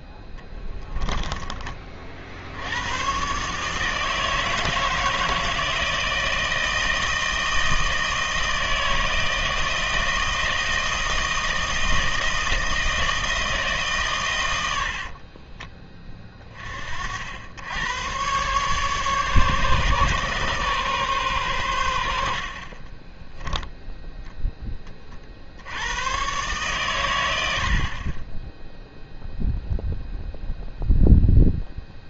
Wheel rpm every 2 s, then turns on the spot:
10, 80, 160, 160, 160, 160, 160, 100, 30, 130, 140, 50, 10, 130, 10, 0.
0-2